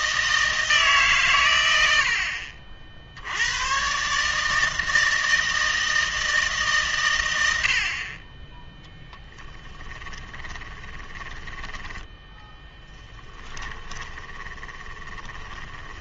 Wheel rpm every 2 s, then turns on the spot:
160, 60, 160, 150, 10, 20, 10, 20.
10-16